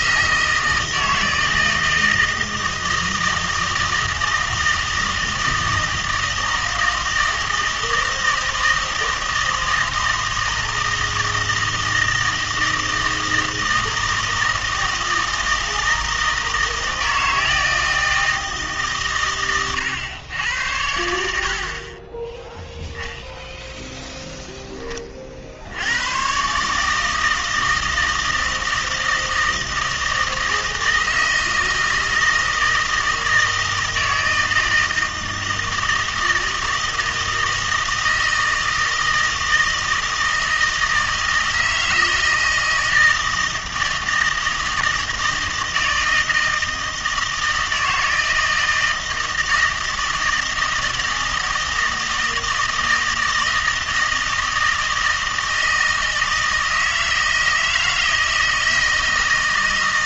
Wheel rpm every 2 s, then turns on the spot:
160, 160, 160, 160, 160, 160, 160, 160, 160, 150, 90, 0, 10, 150, 160, 160, 160, 160, 160, 160, 160, 160, 160, 160, 160, 160, 160, 160, 160, 160.
none